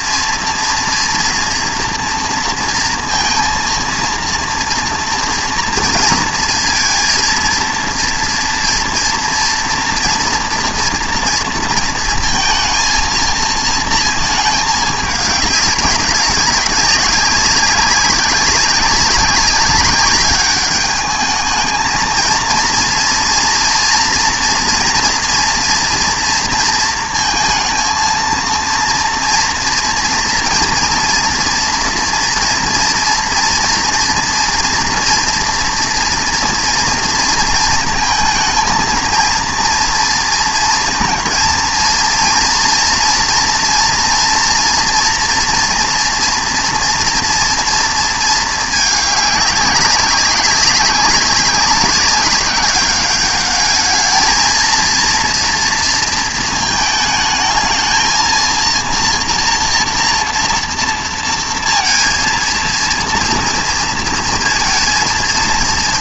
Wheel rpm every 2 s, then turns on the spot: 240, 230, 230, 230, 230, 230, 230, 220, 190, 200, 200, 230, 230, 230, 230, 230, 230, 230, 230, 220, 230, 240, 240, 230, 220, 200, 200, 230, 220, 230, 230, 230, 230.
none